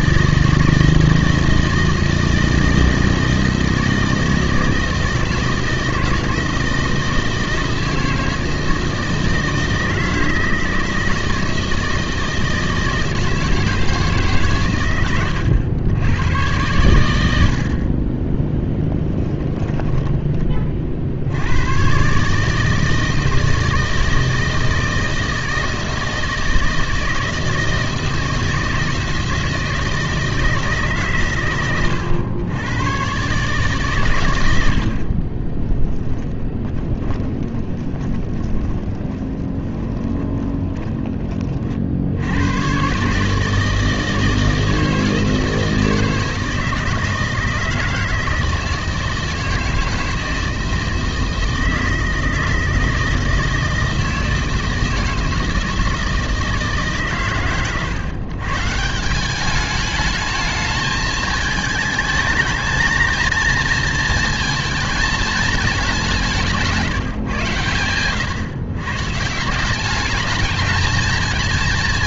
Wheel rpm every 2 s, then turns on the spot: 160, 160, 160, 160, 160, 160, 160, 140, 120, 10, 30, 150, 160, 160, 160, 160, 110, 80, 10, 20, 20, 120, 160, 160, 160, 160, 160, 160, 150, 140, 220, 220, 230, 160, 140, 210.
18-20 36-42